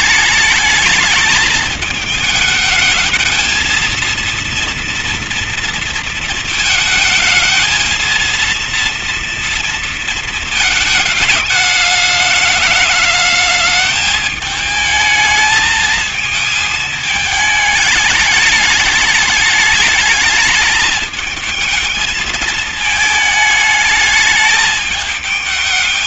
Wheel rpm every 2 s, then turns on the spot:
220, 220, 230, 230, 230, 220, 210, 210, 220, 210, 220, 220, 210.
none